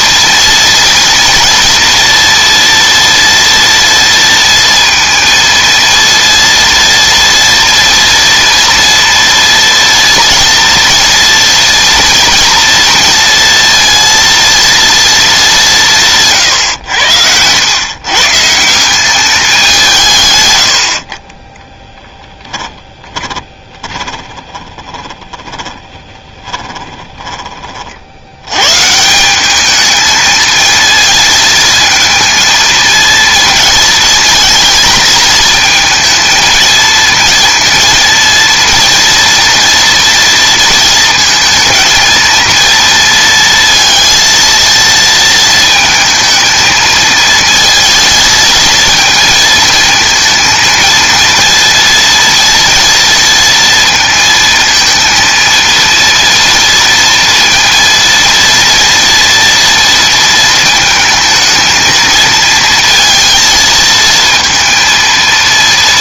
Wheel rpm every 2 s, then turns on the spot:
230, 230, 230, 230, 230, 240, 230, 230, 120, 170, 90, 10, 20, 10, 140, 220, 230, 220, 230, 230, 230, 230, 230, 220, 230, 230, 230, 230, 230, 230, 220, 230, 230.
22-28